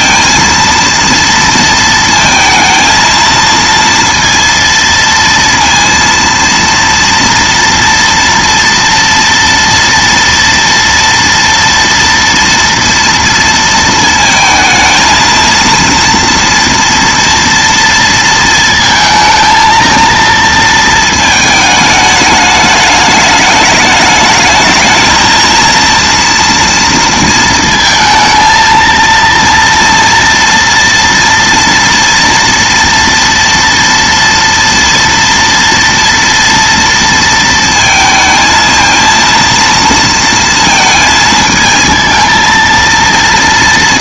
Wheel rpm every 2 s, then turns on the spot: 230, 230, 230, 230, 230, 230, 230, 220, 230, 230, 230, 210, 220, 230, 230, 230, 230, 230, 230, 230, 230, 230.
none